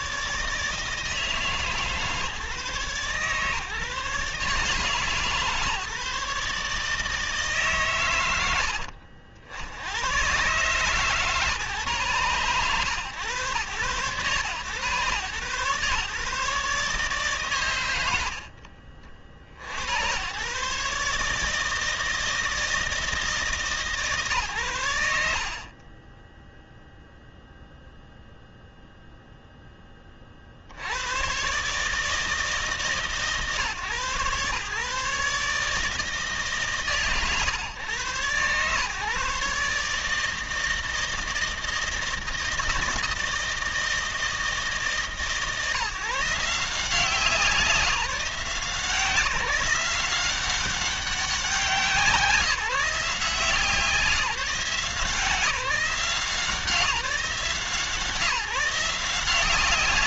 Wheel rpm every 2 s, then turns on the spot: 150, 140, 140, 140, 90, 130, 120, 120, 140, 60, 130, 160, 120, 0, 0, 70, 150, 130, 140, 120, 160, 160, 150, 160, 170, 190, 180, 170, 170, 160.
none